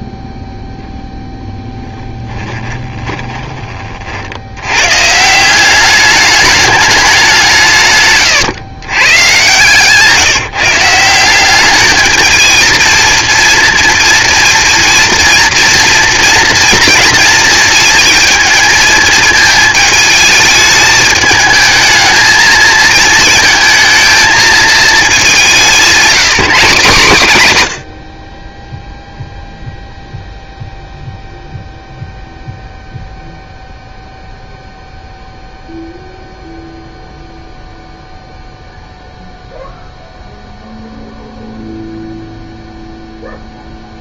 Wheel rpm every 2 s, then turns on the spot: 0, 20, 100, 210, 120, 150, 220, 230, 230, 230, 220, 220, 230, 200, 10, 0, 0, 0, 0, 0, 0, 0.
2-4